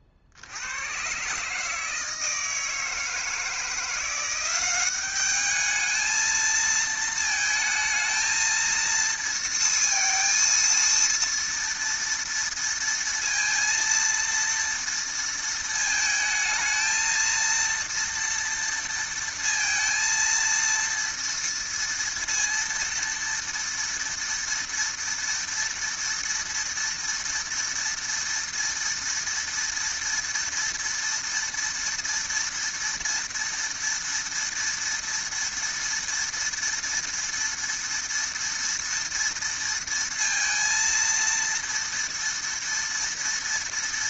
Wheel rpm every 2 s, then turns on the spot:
80, 160, 180, 220, 230, 230, 230, 230, 220, 230, 230, 230, 230, 230, 230, 230, 230, 230, 230, 230, 230, 230.
none